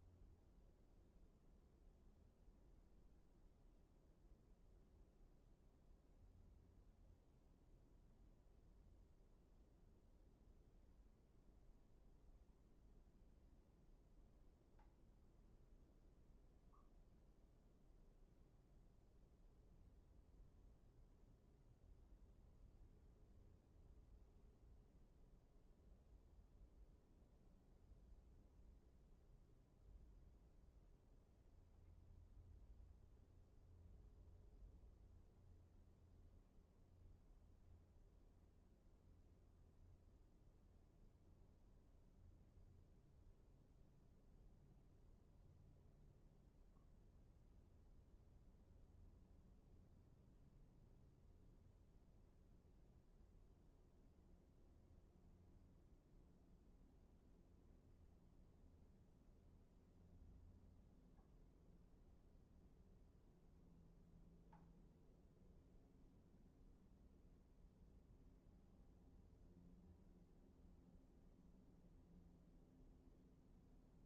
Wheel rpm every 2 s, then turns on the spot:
0, 0, 0, 0, 0, 0, 0, 0, 0, 0, 0, 0, 0, 0, 0, 0, 0, 0, 0, 0, 0, 0, 0, 0, 0, 0, 0, 0, 0, 0, 0, 0, 0, 0, 0, 0, 0.
none